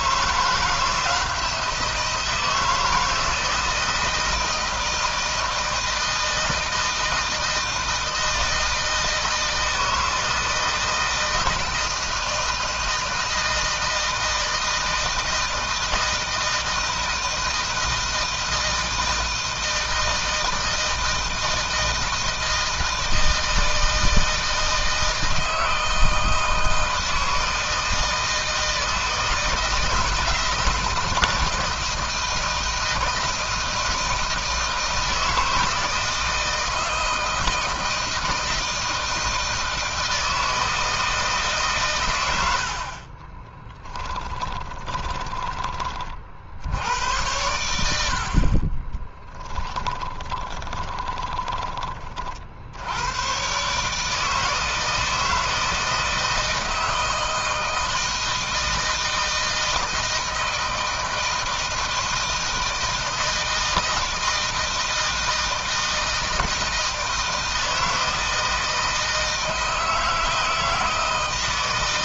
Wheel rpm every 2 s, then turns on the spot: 170, 170, 160, 160, 160, 160, 160, 160, 160, 160, 160, 160, 160, 160, 160, 170, 160, 160, 160, 160, 160, 50, 20, 80, 30, 20, 80, 160, 160, 160, 160, 160, 160, 160, 160, 160.
42-46 48-52